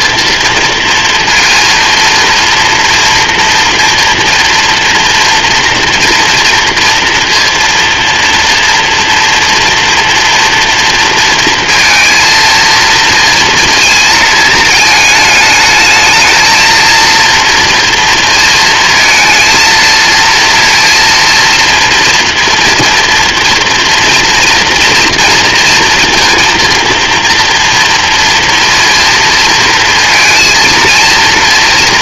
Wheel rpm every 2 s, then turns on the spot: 230, 230, 240, 240, 230, 230, 230, 220, 230, 230, 230, 230, 230, 230, 240, 230.
none